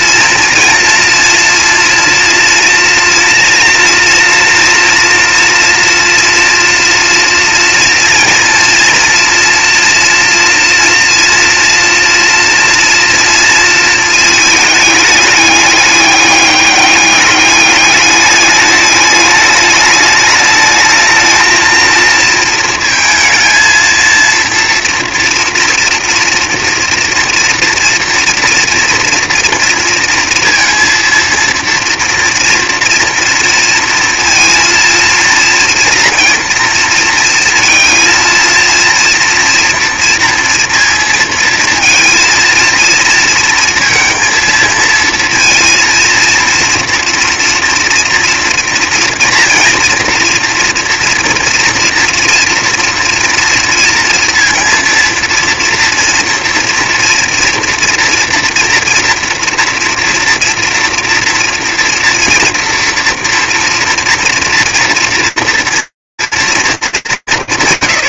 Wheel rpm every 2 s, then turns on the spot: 230, 230, 230, 230, 230, 240, 240, 220, 200, 210, 220, 220, 230, 240, 230, 230, 230, 230, 230, 240, 230, 230, 220, 230, 230, 230, 230, 230, 230, 230, 230, 230, 230, 230.
none